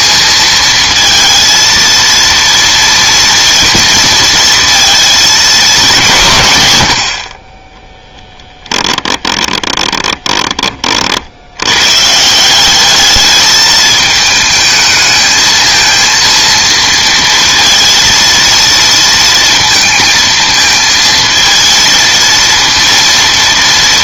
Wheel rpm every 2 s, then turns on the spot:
220, 230, 230, 120, 10, 20, 190, 220, 230, 230, 220, 230.
8-10